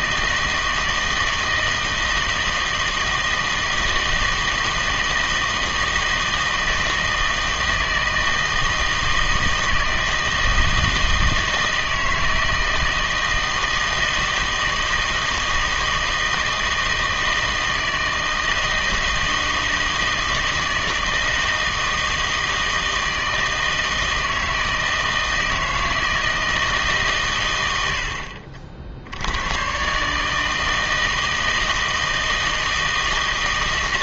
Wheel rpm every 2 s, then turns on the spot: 160, 160, 160, 160, 160, 160, 160, 160, 160, 160, 160, 160, 160, 150, 50, 160, 160.
none